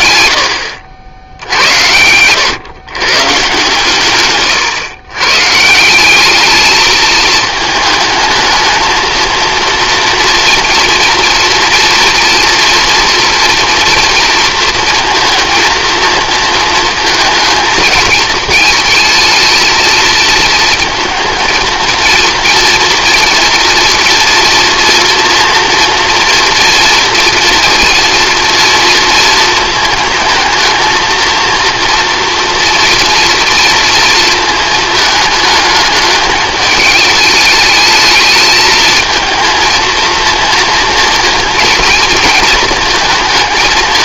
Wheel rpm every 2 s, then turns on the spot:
80, 110, 130, 220, 220, 230, 240, 230, 230, 220, 230, 230, 240, 230, 230, 230, 230, 220, 220, 220, 230, 220.
none